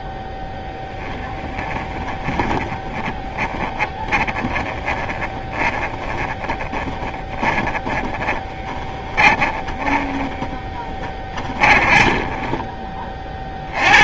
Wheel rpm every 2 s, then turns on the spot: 0, 20, 20, 20, 10, 20, 10.
2-14